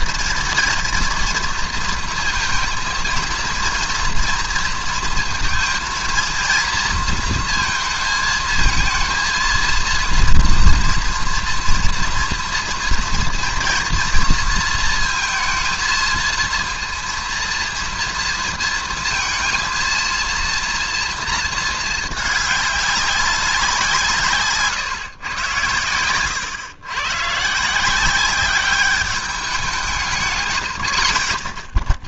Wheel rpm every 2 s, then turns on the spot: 230, 230, 230, 230, 220, 230, 230, 230, 230, 230, 230, 200, 140, 110, 190, 100.
none